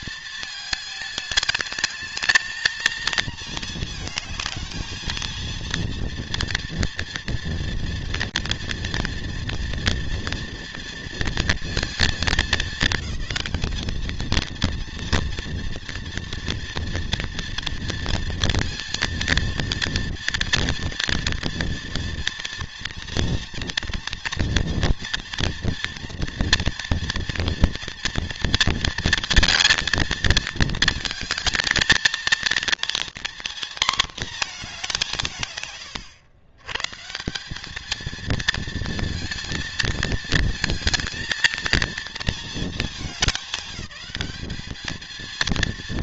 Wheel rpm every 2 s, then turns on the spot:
220, 220, 220, 230, 240, 230, 220, 230, 230, 230, 230, 230, 230, 230, 230, 220, 230, 210, 110, 220, 220, 220, 200.
none